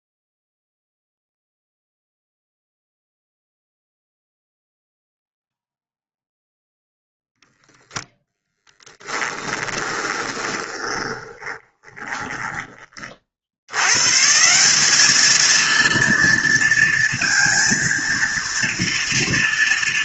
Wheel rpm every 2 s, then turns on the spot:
0, 0, 0, 0, 10, 20, 30, 200, 230, 230.
8-12